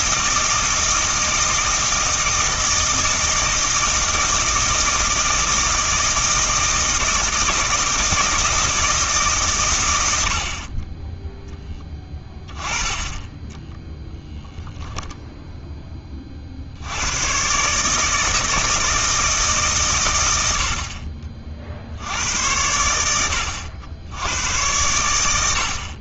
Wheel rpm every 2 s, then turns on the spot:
160, 160, 160, 160, 160, 30, 20, 0, 80, 160, 50, 80, 100.
10-12